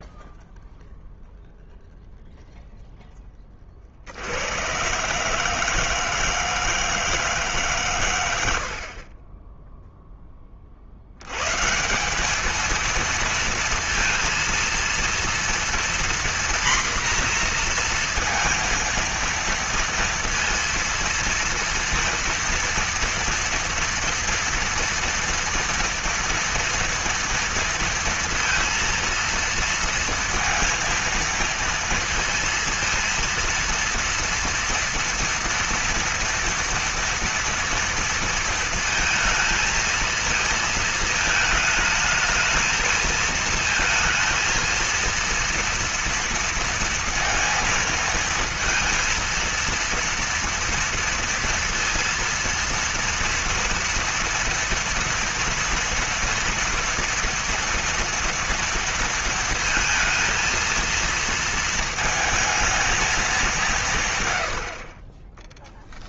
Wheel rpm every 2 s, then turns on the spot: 0, 0, 100, 160, 80, 30, 220, 230, 240, 230, 230, 230, 230, 230, 230, 230, 230, 230, 240, 230, 230, 220, 230, 230, 230, 230, 230, 230, 230, 230, 230, 220, 100.
none